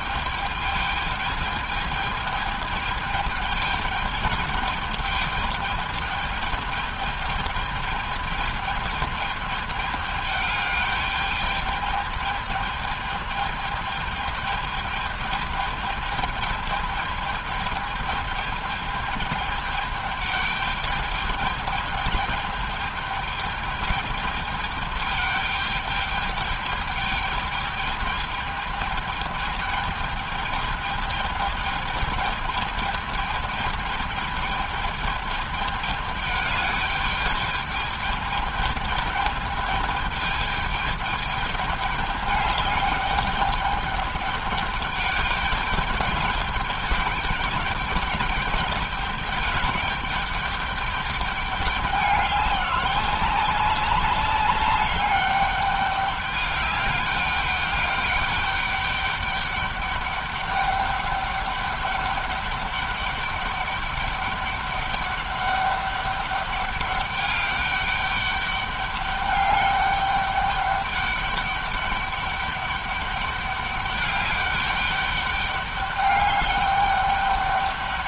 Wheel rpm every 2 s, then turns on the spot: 210, 210, 210, 210, 210, 210, 210, 210, 210, 210, 210, 210, 210, 210, 210, 210, 210, 210, 210, 210, 210, 200, 200, 200, 210, 200, 190, 200, 200, 200, 200, 200, 200, 200, 200, 200, 200, 210, 200.
none